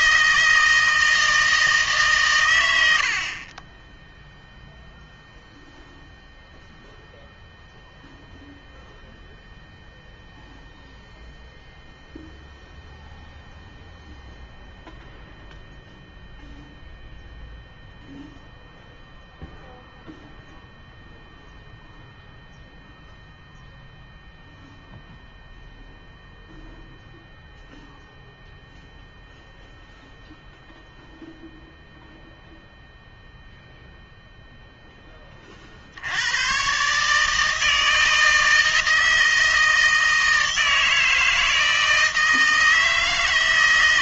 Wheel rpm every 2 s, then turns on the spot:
160, 110, 0, 0, 0, 0, 0, 0, 0, 0, 0, 0, 0, 0, 0, 0, 0, 0, 120, 160, 160, 160.
none